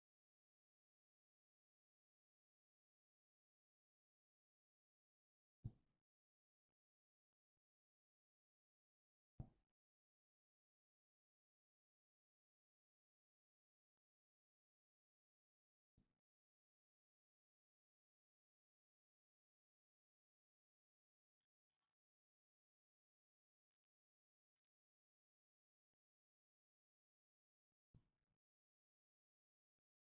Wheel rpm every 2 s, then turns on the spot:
0, 0, 0, 0, 0, 0, 0, 0, 0, 0, 0, 0, 0, 0, 0.
none